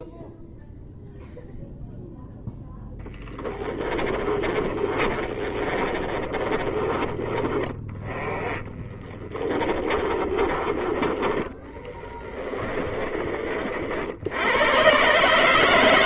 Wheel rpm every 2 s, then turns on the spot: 0, 0, 30, 20, 20, 30, 20, 100.
4-14